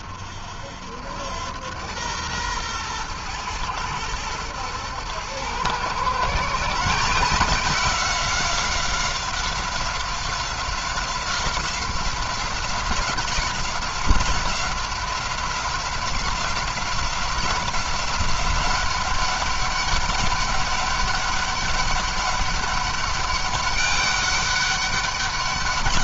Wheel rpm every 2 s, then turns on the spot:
70, 110, 110, 160, 190, 190, 190, 190, 180, 190, 200, 200, 200.
none